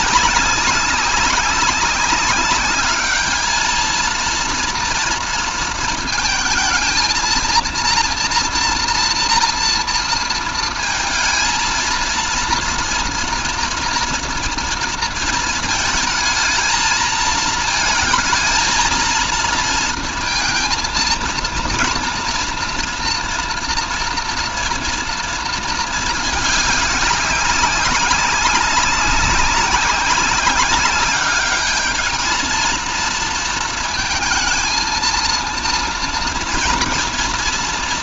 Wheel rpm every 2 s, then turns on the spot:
190, 200, 230, 220, 240, 230, 230, 230, 220, 220, 230, 230, 230, 200, 190, 200, 230, 230, 230.
none